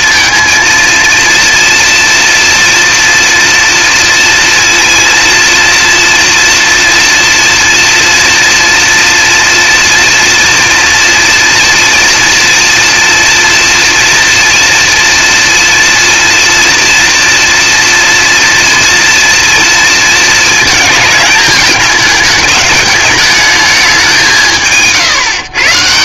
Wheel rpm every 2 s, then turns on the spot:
230, 230, 230, 230, 240, 230, 230, 230, 230, 230, 220, 210, 160.
none